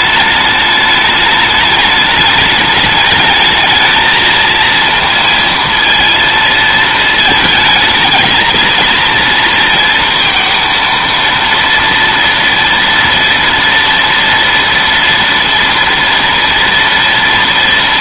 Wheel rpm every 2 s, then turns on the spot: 210, 210, 230, 230, 220, 230, 230, 240, 230.
none